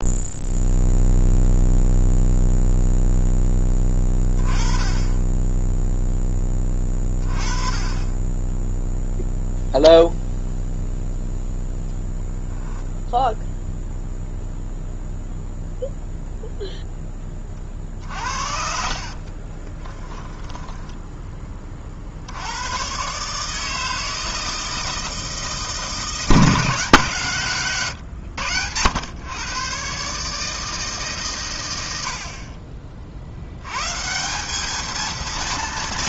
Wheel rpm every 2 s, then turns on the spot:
0, 0, 20, 20, 0, 0, 0, 0, 10, 50, 10, 130, 160, 160, 100, 150, 50, 220.
18-20